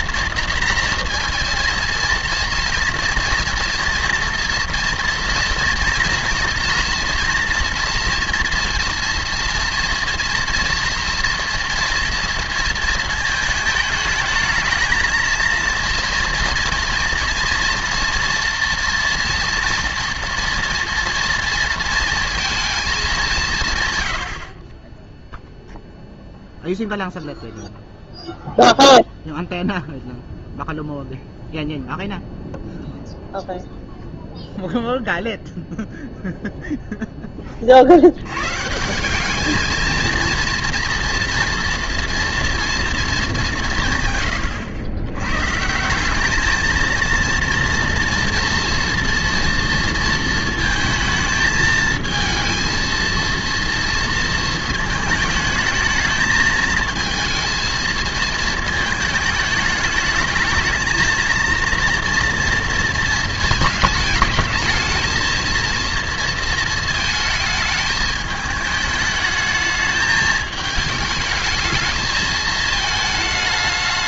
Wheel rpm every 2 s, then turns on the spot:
230, 230, 230, 230, 240, 230, 230, 220, 230, 230, 240, 220, 40, 0, 0, 0, 0, 0, 0, 140, 230, 230, 110, 220, 230, 230, 230, 230, 220, 220, 220, 230, 220, 230, 210, 220, 220.
none